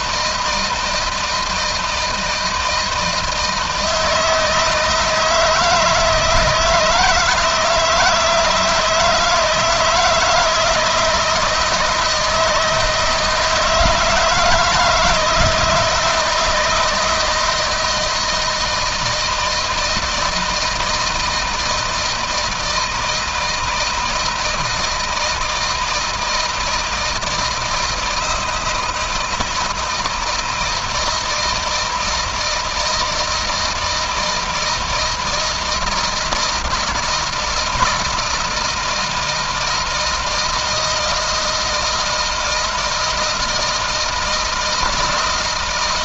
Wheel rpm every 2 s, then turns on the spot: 160, 160, 160, 160, 160, 160, 160, 160, 170, 160, 160, 160, 160, 160, 170, 160, 160, 160, 160, 160, 160, 160, 160.
none